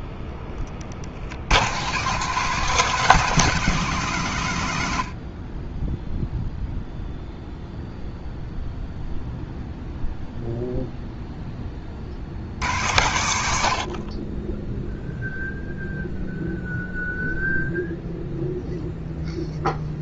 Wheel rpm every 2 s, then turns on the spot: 50, 170, 90, 0, 0, 0, 100, 0, 0, 0.
none